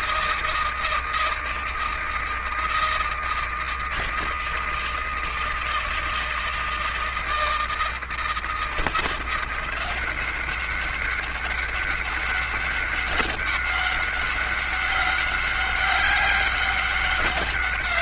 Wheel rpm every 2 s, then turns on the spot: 160, 160, 160, 160, 170, 200, 200, 200, 200.
none